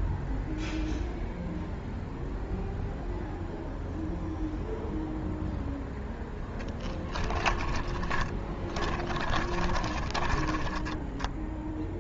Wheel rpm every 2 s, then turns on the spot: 0, 0, 0, 10, 20, 10.
6-12